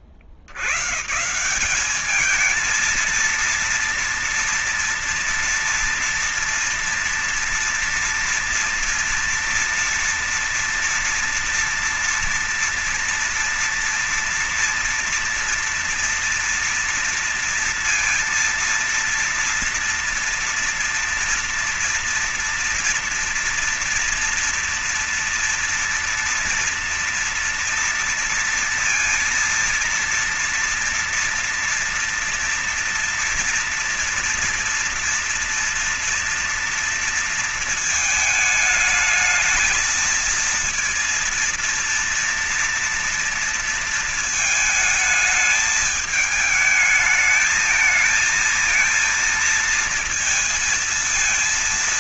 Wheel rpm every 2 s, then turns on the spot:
60, 210, 230, 230, 230, 230, 230, 230, 230, 230, 230, 230, 240, 230, 230, 230, 230, 230, 230, 220, 230, 230, 220, 220, 220, 230.
none